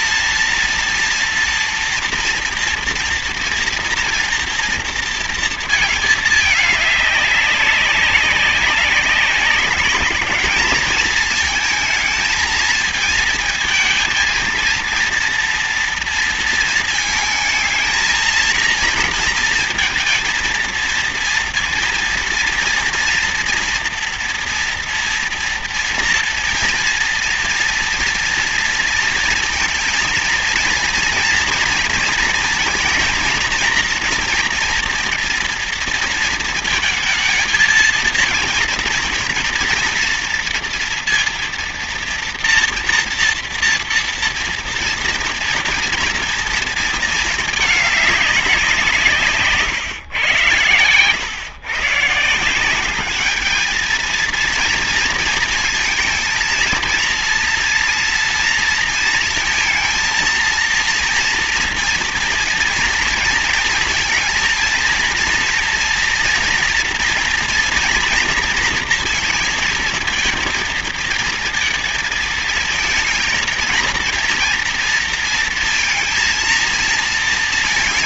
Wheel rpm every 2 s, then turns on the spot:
230, 230, 230, 210, 200, 220, 220, 230, 220, 230, 230, 230, 230, 230, 230, 230, 230, 230, 230, 230, 230, 230, 230, 220, 180, 120, 190, 230, 230, 230, 230, 230, 230, 230, 230, 230, 220, 230, 230.
none